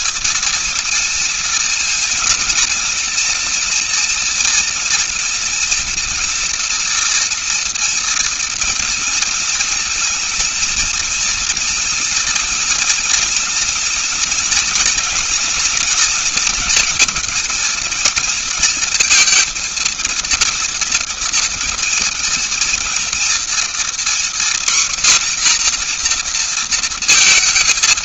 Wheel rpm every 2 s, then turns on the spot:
230, 230, 230, 230, 240, 230, 230, 230, 230, 230, 230, 230, 250, 240.
none